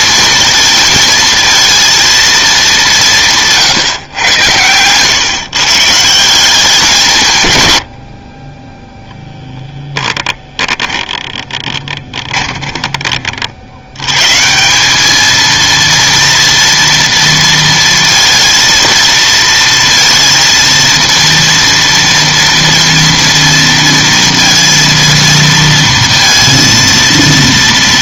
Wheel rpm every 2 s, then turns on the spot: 230, 210, 120, 180, 20, 20, 20, 170, 230, 230, 230, 230, 230, 230.
4-6 12-14